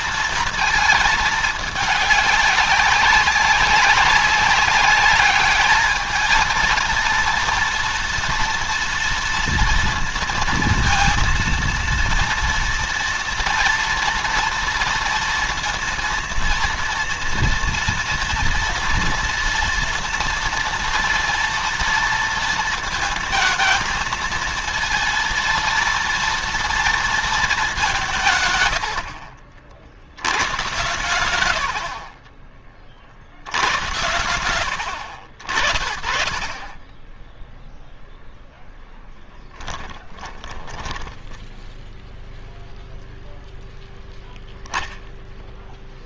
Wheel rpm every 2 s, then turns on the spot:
230, 200, 200, 230, 230, 230, 240, 230, 230, 230, 230, 230, 230, 230, 90, 120, 30, 70, 20, 0, 10, 0, 0.
28-30 40-42